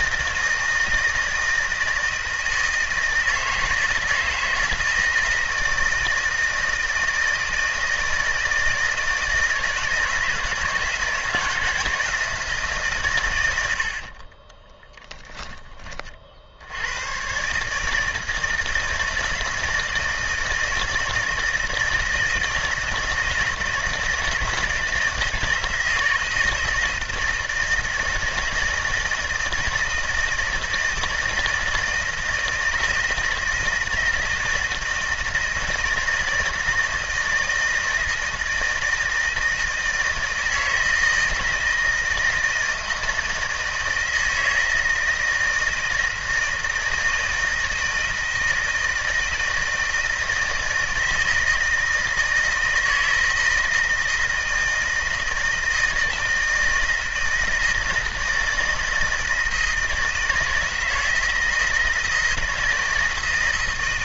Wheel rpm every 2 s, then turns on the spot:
160, 160, 160, 160, 160, 160, 140, 10, 90, 160, 160, 160, 160, 160, 160, 160, 160, 160, 160, 160, 160, 160, 160, 160, 160, 160, 160, 160, 160, 160, 160, 170.
14-16